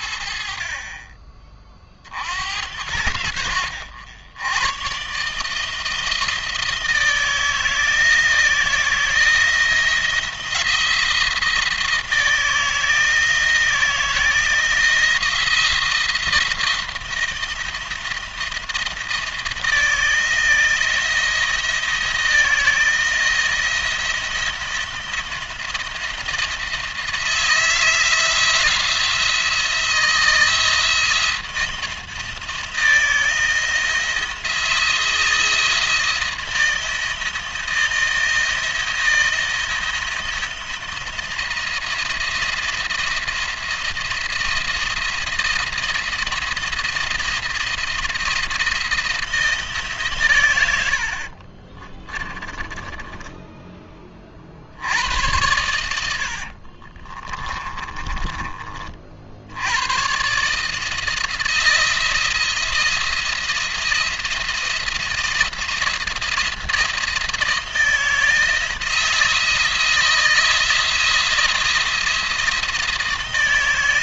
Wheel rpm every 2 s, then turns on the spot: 30, 80, 120, 160, 160, 170, 170, 160, 170, 170, 160, 160, 170, 160, 170, 160, 160, 160, 170, 170, 170, 170, 170, 170, 170, 90, 20, 60, 40, 40, 150, 170, 160, 170, 160, 170, 170.
52-54 56-58